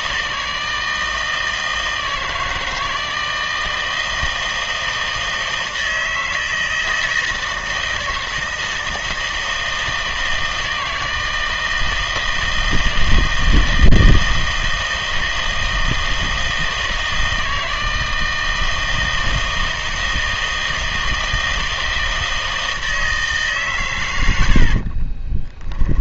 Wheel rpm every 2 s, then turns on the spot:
160, 160, 160, 160, 160, 160, 160, 160, 160, 160, 160, 160, 50.
24-26